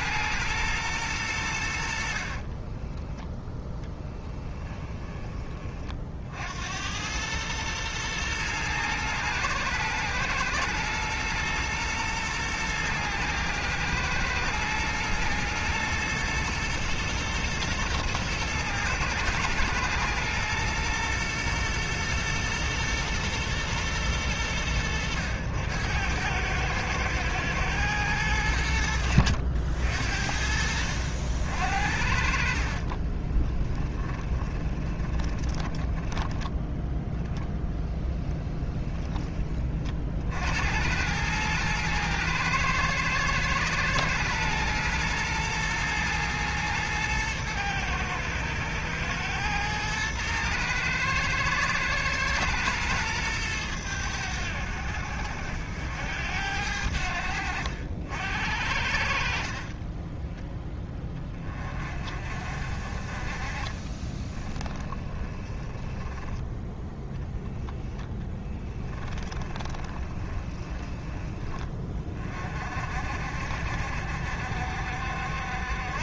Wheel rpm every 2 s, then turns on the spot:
120, 20, 20, 80, 110, 120, 110, 110, 120, 110, 120, 120, 100, 110, 80, 60, 50, 20, 10, 10, 80, 110, 120, 120, 110, 110, 110, 80, 80, 70, 10, 30, 20, 10, 10, 20, 40, 60.
2-6 32-36 38-40 64-66 68-72